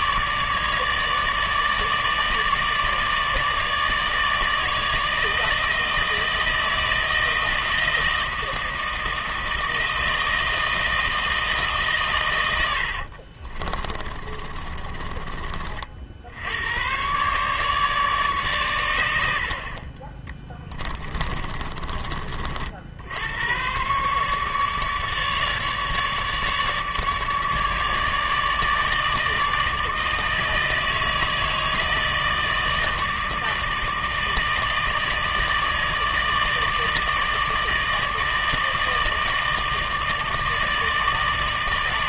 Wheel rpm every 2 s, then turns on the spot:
150, 150, 160, 160, 160, 160, 70, 30, 110, 100, 30, 70, 150, 150, 150, 160, 160, 160, 160, 160, 160.
12-16 20-22